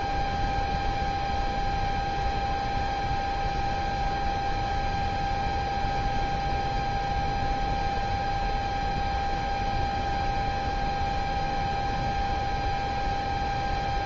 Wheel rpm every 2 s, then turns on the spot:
0, 0, 0, 0, 0, 0, 0.
none